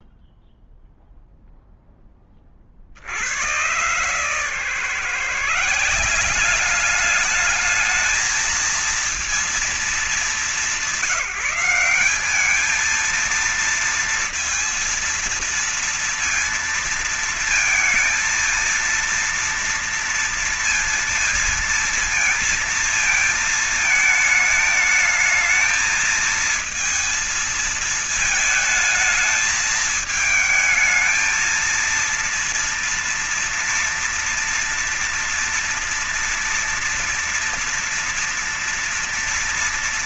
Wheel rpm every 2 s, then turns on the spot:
0, 40, 140, 190, 220, 190, 210, 230, 230, 230, 230, 230, 220, 230, 220, 220, 230, 230, 230, 230.
none